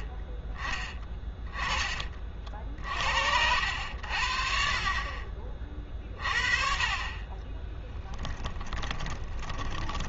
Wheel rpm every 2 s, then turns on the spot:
20, 50, 40, 40, 20.
8-10